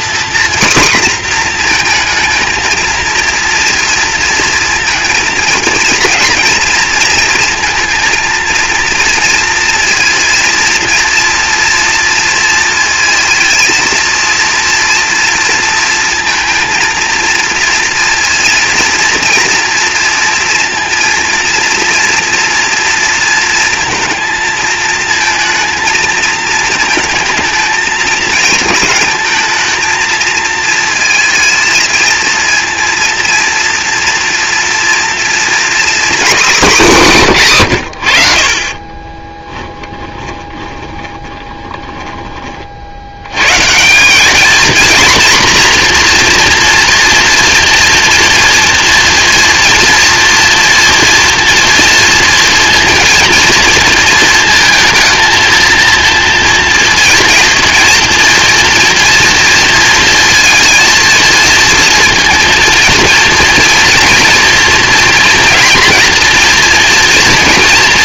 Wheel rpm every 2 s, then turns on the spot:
240, 220, 230, 230, 230, 230, 230, 230, 230, 230, 230, 230, 220, 220, 230, 230, 230, 240, 240, 50, 10, 40, 220, 240, 230, 230, 230, 230, 230, 230, 230, 230, 230, 230.
40-42